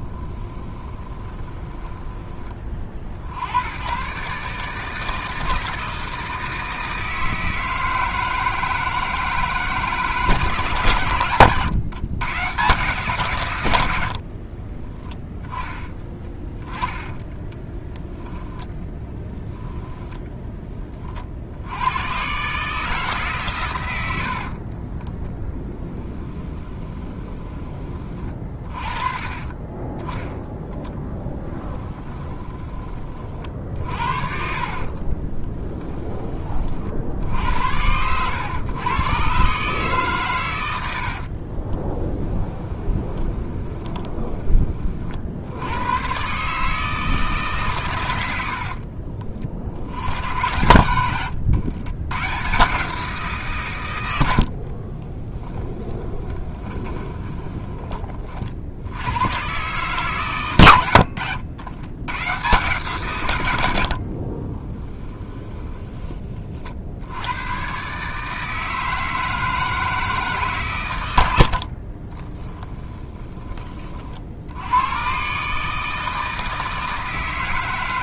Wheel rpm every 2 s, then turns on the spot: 10, 30, 150, 160, 160, 140, 140, 40, 10, 10, 20, 150, 40, 20, 30, 10, 30, 60, 40, 120, 100, 20, 30, 150, 60, 90, 130, 60, 20, 70, 110, 140, 20, 50, 160, 130, 20, 90, 160.
0-2 14-20 24-28 34-36 42-44 48-50 54-58 64-66 72-74